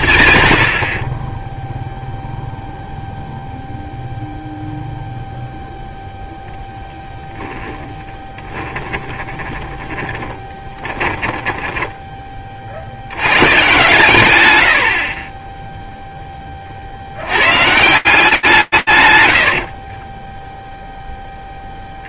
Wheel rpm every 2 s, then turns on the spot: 0, 0, 0, 30, 20, 50, 80, 50, 140, 0, 50.
6-10